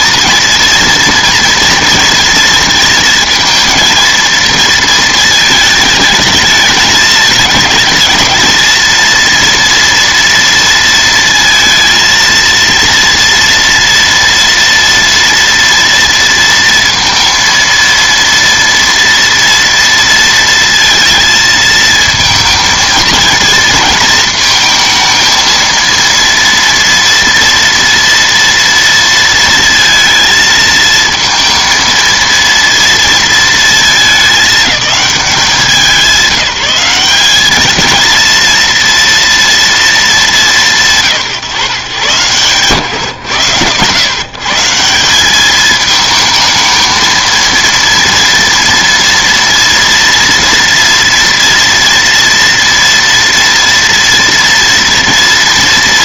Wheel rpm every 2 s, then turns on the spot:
230, 230, 230, 220, 220, 230, 230, 230, 230, 230, 230, 230, 230, 230, 230, 220, 230, 210, 190, 230, 190, 130, 160, 220, 230, 230, 230, 230.
none